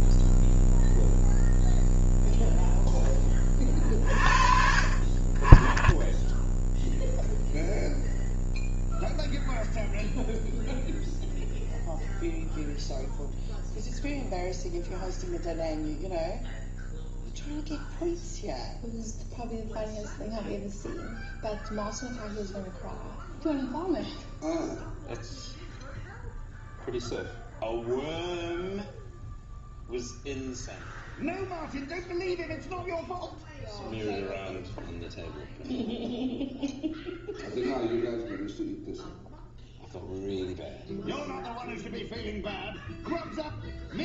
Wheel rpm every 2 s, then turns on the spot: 0, 0, 40, 0, 0, 0, 0, 0, 0, 0, 0, 0, 0, 0, 0, 0, 0, 0, 0, 0, 0, 0.
none